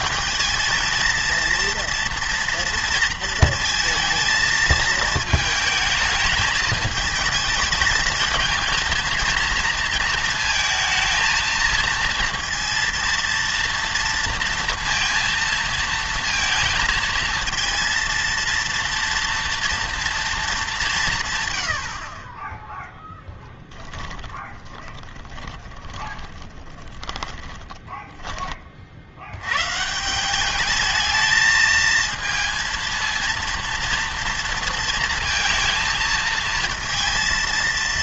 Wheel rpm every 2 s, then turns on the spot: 220, 230, 220, 210, 220, 220, 230, 230, 230, 230, 210, 10, 20, 20, 30, 210, 230, 230, 220.
24-28